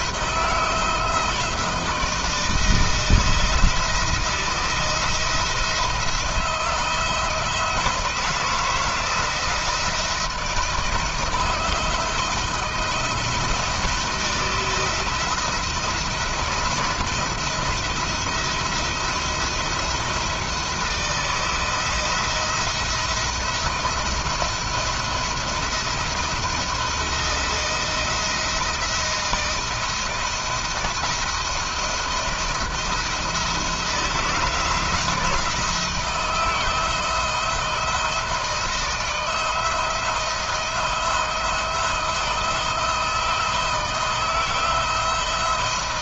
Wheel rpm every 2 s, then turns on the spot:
170, 170, 160, 160, 170, 160, 160, 160, 160, 170, 160, 170, 170, 160, 170, 170, 170, 170, 160, 170, 170, 170, 170.
none